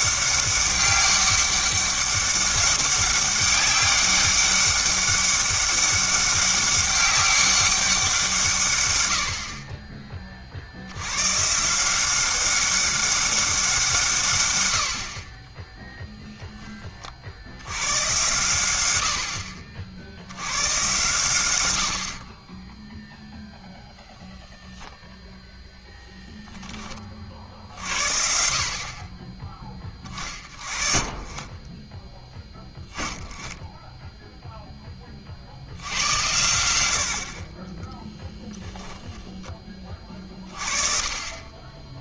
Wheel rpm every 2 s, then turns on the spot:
200, 200, 200, 200, 140, 50, 190, 100, 10, 100, 110, 10, 0, 10, 50, 40, 10, 10, 80, 10, 30.
none